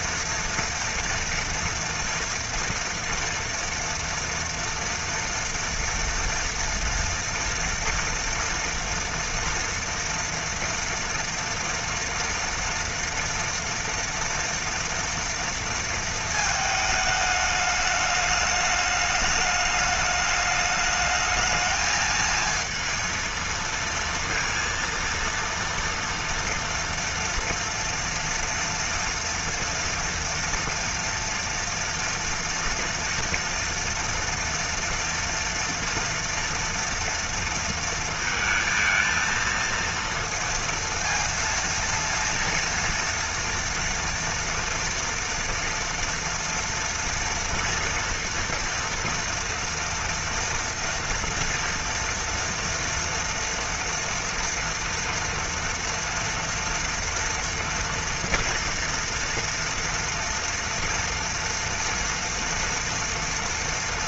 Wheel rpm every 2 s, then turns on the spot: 230, 230, 230, 230, 230, 230, 230, 230, 220, 210, 210, 230, 230, 230, 230, 230, 230, 230, 230, 220, 230, 230, 230, 230, 230, 230, 230, 240, 230, 230, 230, 230.
none